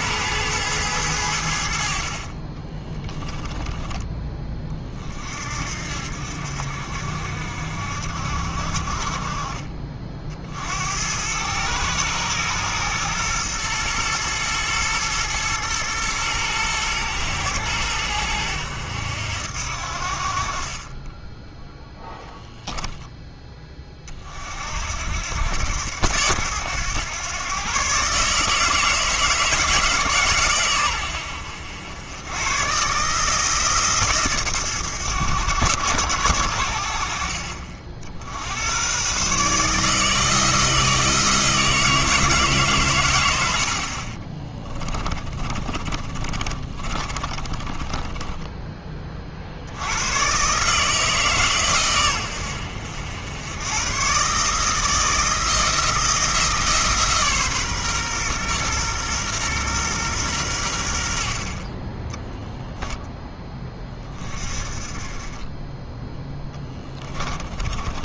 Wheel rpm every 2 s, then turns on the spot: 100, 30, 30, 60, 50, 70, 110, 110, 110, 90, 30, 10, 70, 110, 160, 120, 140, 110, 70, 110, 160, 130, 20, 30, 20, 150, 80, 160, 150, 120, 80, 0, 30, 10.
2-4 44-48 66-68